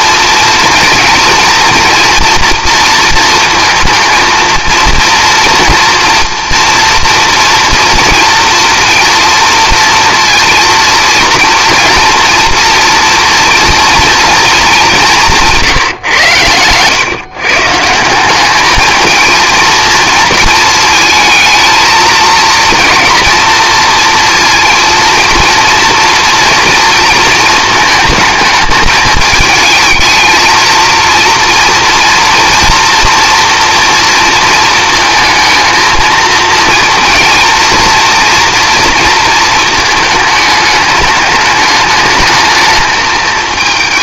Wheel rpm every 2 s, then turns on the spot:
230, 230, 230, 230, 230, 230, 230, 210, 120, 210, 220, 220, 230, 230, 220, 230, 230, 230, 230, 230, 220, 210.
none